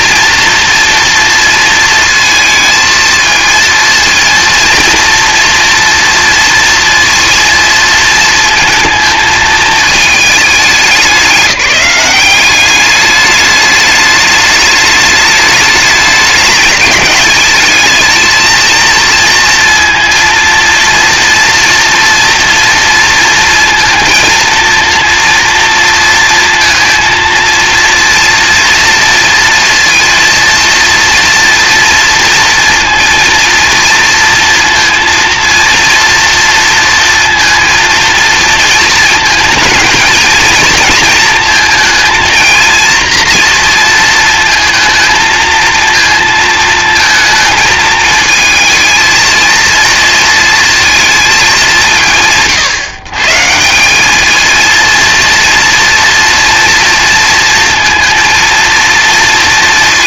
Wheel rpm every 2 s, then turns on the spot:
240, 230, 230, 230, 230, 210, 200, 210, 210, 220, 230, 230, 230, 230, 230, 230, 230, 230, 230, 220, 230, 230, 220, 230, 230, 230, 150, 230, 230, 230.
none